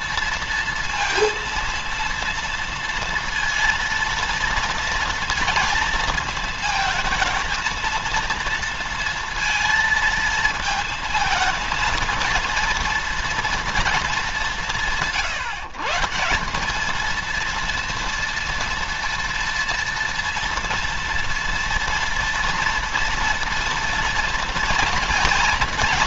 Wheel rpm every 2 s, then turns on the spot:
230, 230, 230, 220, 230, 220, 230, 170, 210, 230, 230, 230, 220.
none